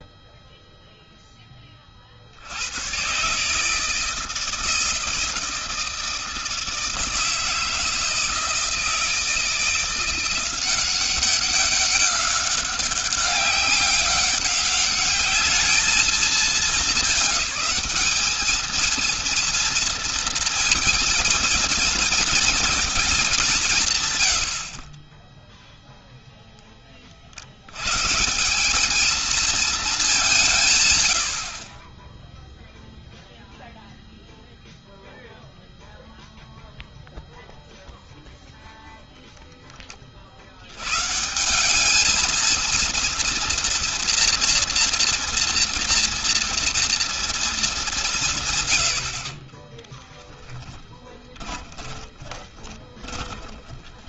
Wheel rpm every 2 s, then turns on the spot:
0, 110, 160, 160, 160, 180, 190, 200, 200, 230, 230, 220, 50, 20, 210, 120, 0, 0, 0, 0, 90, 230, 240, 230, 90, 20, 20.
50-54